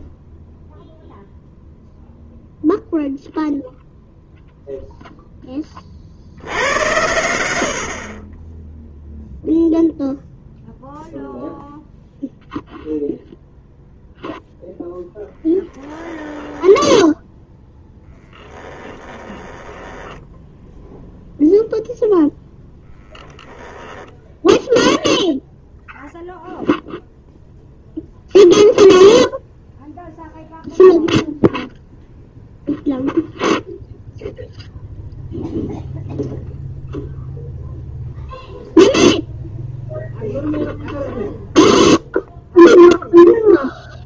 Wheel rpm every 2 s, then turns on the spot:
0, 0, 0, 90, 30, 0, 0, 0, 10, 10, 10, 0, 10, 0, 0, 0, 0, 0, 0, 0, 0, 0.
16-22